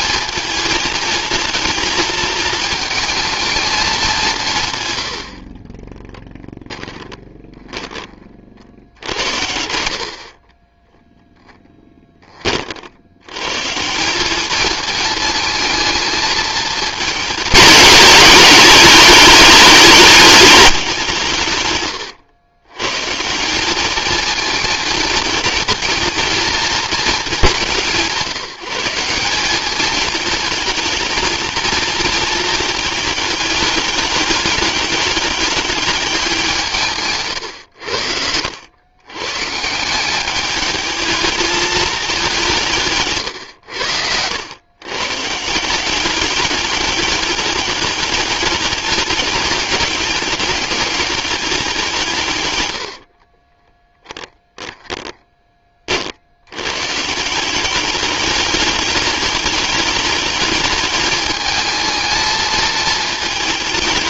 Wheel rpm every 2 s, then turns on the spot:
220, 220, 120, 20, 60, 10, 80, 220, 220, 210, 180, 120, 230, 220, 180, 220, 220, 210, 160, 100, 220, 140, 130, 210, 210, 210, 80, 10, 140, 210, 210, 220.
6-12 52-56